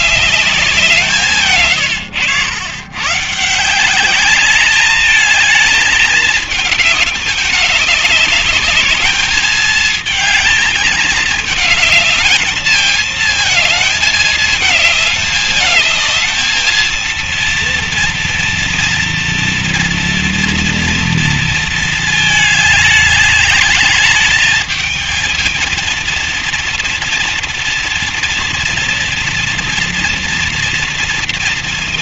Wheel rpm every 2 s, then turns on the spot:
160, 140, 220, 200, 210, 220, 220, 220, 230, 230, 230, 210, 220, 230, 240, 230.
none